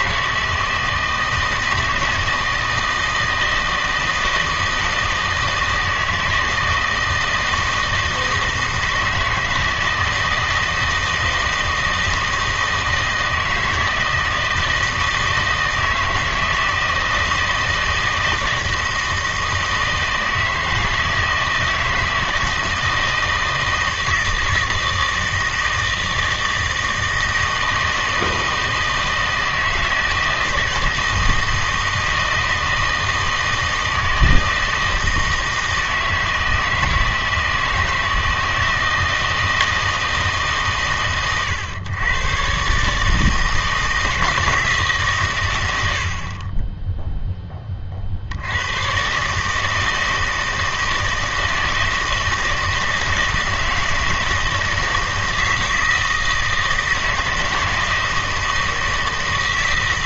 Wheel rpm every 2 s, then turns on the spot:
160, 160, 160, 160, 160, 160, 160, 160, 160, 160, 160, 160, 160, 160, 160, 160, 160, 160, 160, 160, 140, 130, 160, 10, 100, 160, 160, 160, 160, 160.
none